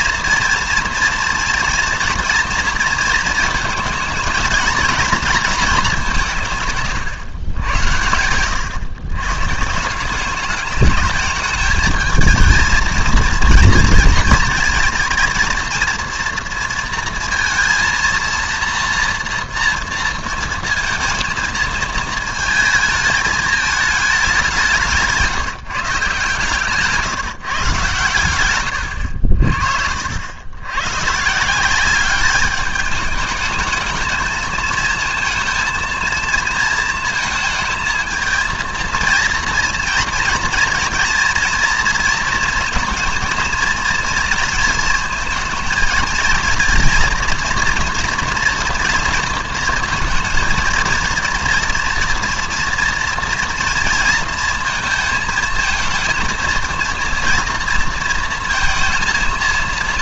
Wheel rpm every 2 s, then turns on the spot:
230, 230, 230, 140, 120, 210, 220, 230, 230, 230, 230, 220, 180, 160, 110, 100, 210, 220, 230, 230, 230, 230, 230, 230, 230, 230, 230, 230, 230, 230.
none